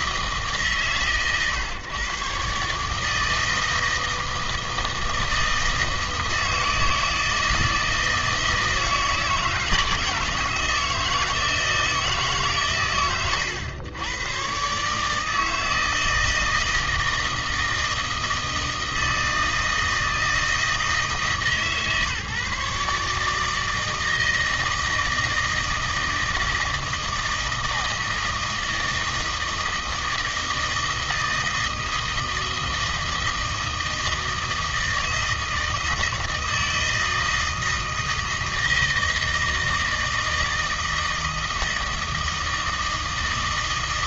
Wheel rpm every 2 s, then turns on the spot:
150, 140, 160, 160, 160, 160, 140, 120, 160, 160, 160, 150, 160, 160, 160, 160, 160, 160, 160, 160, 160, 160.
none